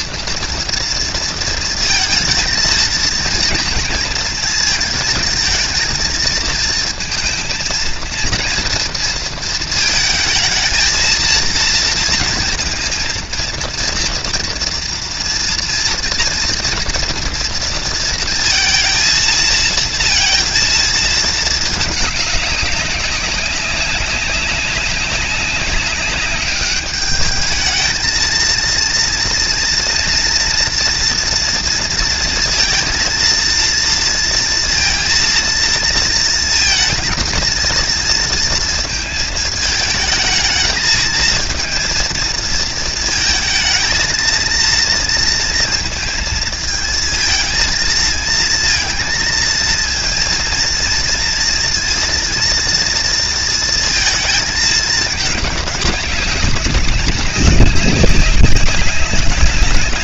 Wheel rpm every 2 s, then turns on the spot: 230, 230, 230, 230, 230, 220, 230, 230, 230, 230, 230, 190, 200, 200, 230, 240, 230, 230, 230, 220, 220, 230, 230, 220, 230, 230, 230, 210, 200, 190.
none